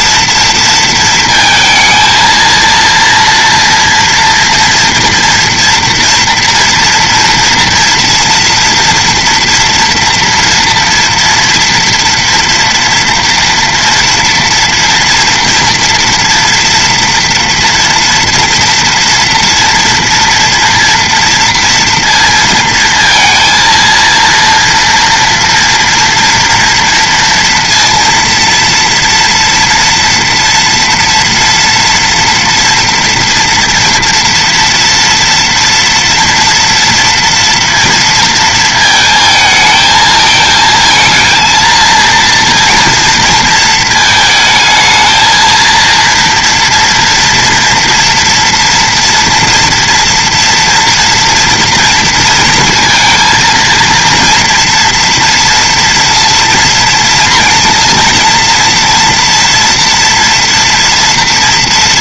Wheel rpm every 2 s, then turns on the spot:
230, 230, 230, 230, 230, 230, 230, 230, 230, 240, 240, 230, 230, 230, 230, 230, 230, 230, 230, 230, 220, 230, 220, 230, 230, 230, 230, 230, 230, 230, 230.
none